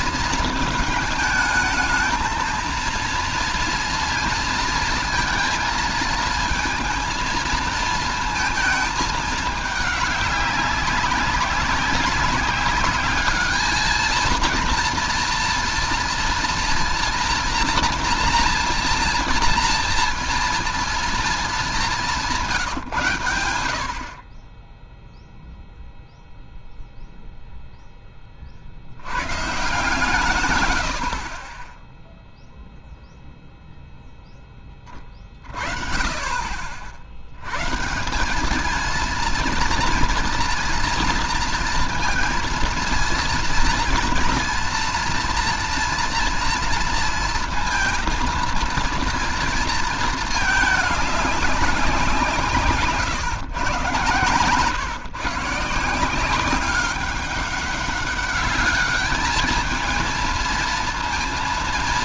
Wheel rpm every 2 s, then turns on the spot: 220, 230, 230, 230, 220, 190, 200, 230, 230, 230, 230, 140, 10, 0, 40, 110, 0, 20, 50, 210, 240, 230, 230, 230, 230, 220, 160, 130, 190, 200, 230.
none